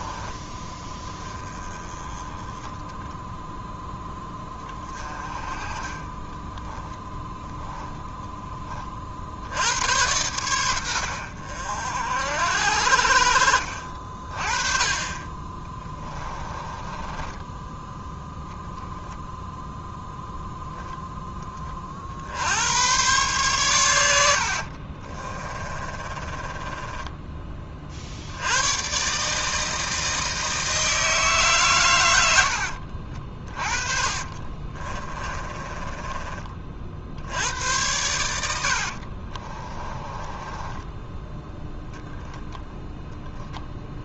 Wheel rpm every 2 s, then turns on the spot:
10, 10, 20, 10, 20, 100, 60, 30, 20, 10, 0, 90, 50, 20, 90, 160, 70, 30, 40, 80, 20, 0.
6-8 16-18 24-28 32-36 38-40